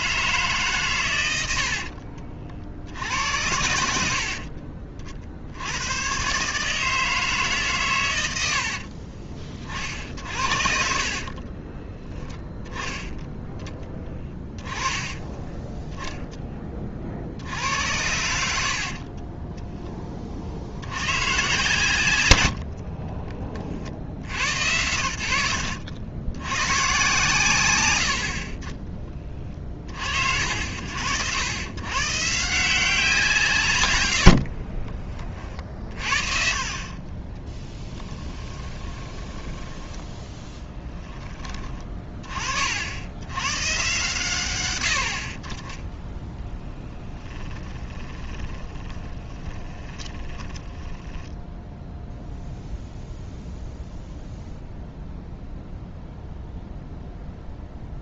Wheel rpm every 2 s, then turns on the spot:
130, 60, 50, 160, 50, 50, 10, 20, 20, 70, 80, 60, 80, 120, 30, 90, 170, 40, 40, 20, 10, 60, 100, 10, 20, 10, 0, 0, 0.
8-12 14-16 22-24 34-40 48-52